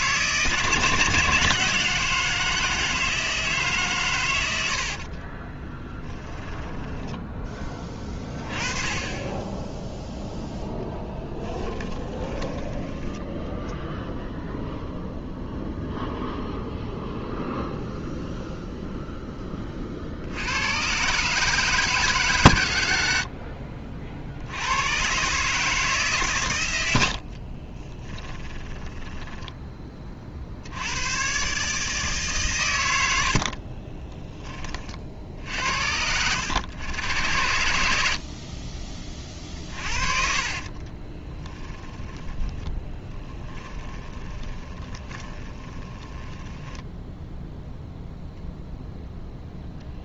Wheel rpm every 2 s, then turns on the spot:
160, 160, 70, 10, 20, 10, 10, 0, 0, 0, 110, 90, 100, 70, 10, 80, 100, 40, 90, 30, 30, 10, 20, 10, 0.
4-8 12-14 22-24 28-30 40-48